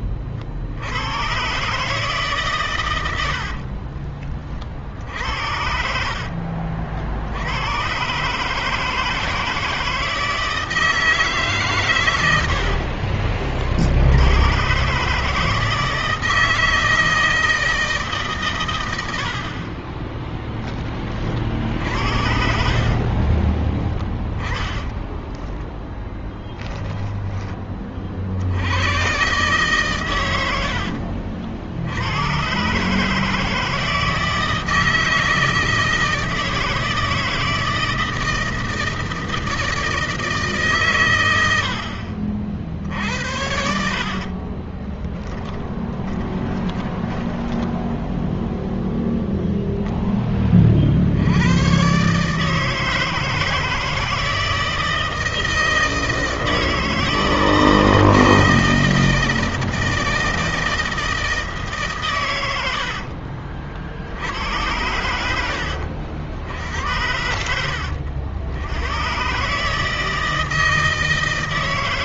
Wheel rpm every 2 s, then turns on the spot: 60, 140, 30, 50, 140, 160, 90, 100, 160, 130, 10, 60, 20, 10, 70, 90, 120, 160, 160, 160, 160, 60, 40, 30, 0, 30, 150, 160, 160, 160, 160, 100, 80, 70, 90, 160.
12-14 22-28 44-48